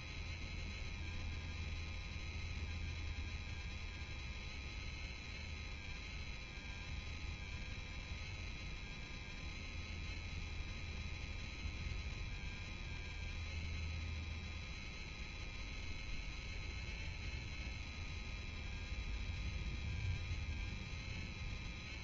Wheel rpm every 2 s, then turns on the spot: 0, 0, 0, 0, 0, 0, 0, 0, 0, 0, 0.
none